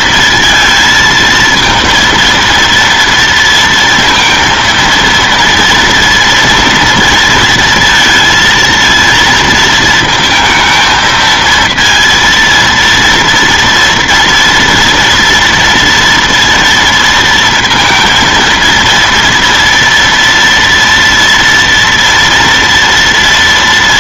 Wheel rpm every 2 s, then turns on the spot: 220, 230, 230, 230, 230, 220, 230, 230, 230, 230, 230, 230.
none